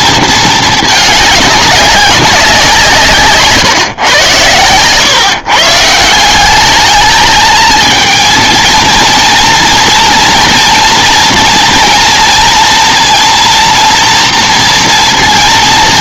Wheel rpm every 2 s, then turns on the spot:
220, 180, 110, 190, 230, 230, 230, 230.
none